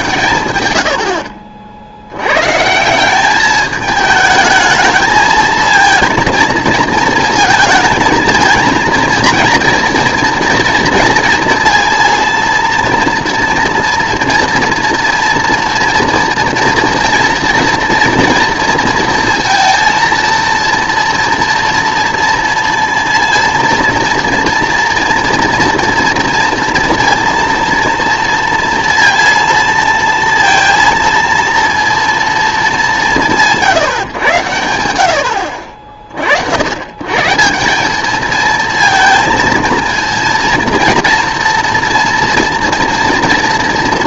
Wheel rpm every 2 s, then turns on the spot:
120, 140, 220, 230, 230, 230, 230, 230, 230, 230, 230, 230, 230, 230, 230, 230, 210, 90, 90, 220, 230, 230.
none